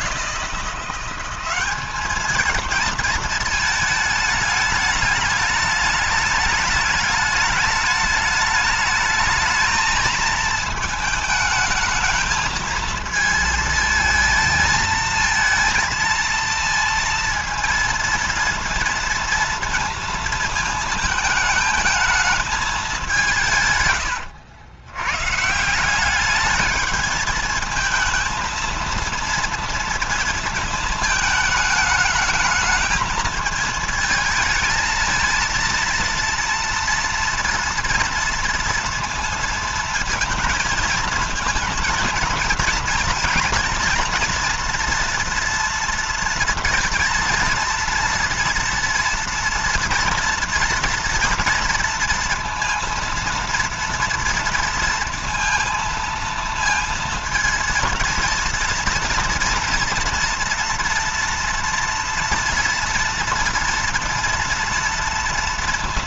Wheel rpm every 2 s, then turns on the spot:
180, 220, 210, 210, 210, 220, 220, 230, 230, 230, 220, 180, 110, 220, 230, 220, 220, 220, 230, 230, 230, 230, 230, 230, 230, 230, 230, 230, 230, 230, 230, 230, 230.
none